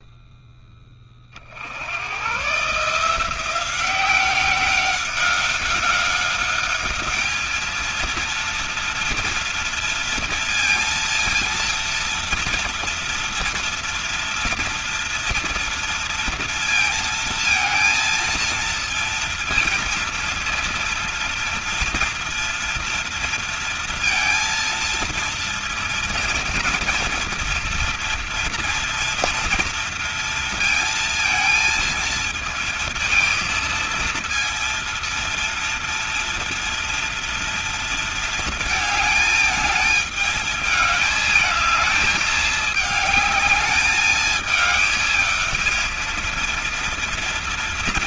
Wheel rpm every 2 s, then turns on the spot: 20, 160, 190, 210, 230, 230, 230, 230, 230, 230, 230, 230, 230, 230, 230, 230, 220, 230, 230, 220, 210, 210, 210, 230.
none